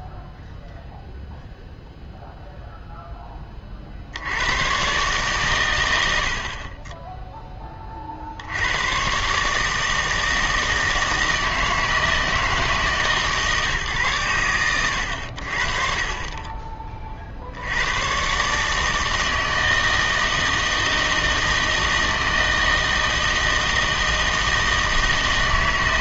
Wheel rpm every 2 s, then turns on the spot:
0, 0, 110, 40, 90, 160, 160, 110, 30, 140, 160, 160, 160.
none